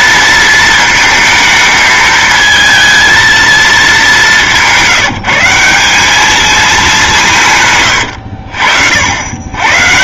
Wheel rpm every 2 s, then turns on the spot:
230, 220, 190, 210, 70.
none